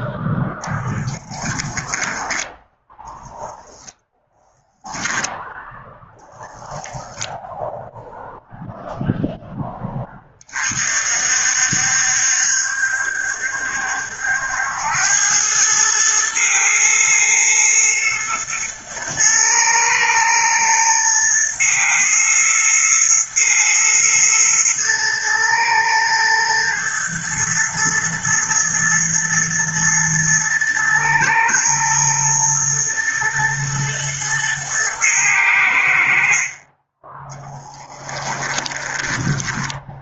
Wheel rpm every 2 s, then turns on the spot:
10, 10, 0, 10, 0, 50, 70, 90, 110, 110, 110, 110, 120, 120, 120, 110, 120, 110, 20, 10.
38-40